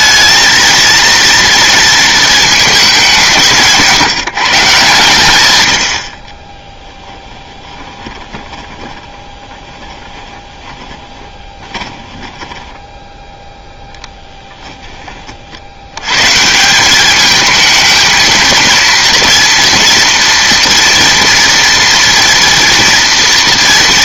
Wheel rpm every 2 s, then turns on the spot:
230, 210, 150, 10, 20, 20, 10, 10, 180, 230, 230, 230.
6-14